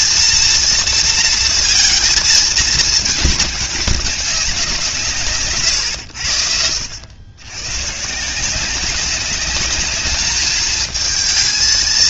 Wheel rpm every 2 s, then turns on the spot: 230, 220, 180, 80, 190, 220.
none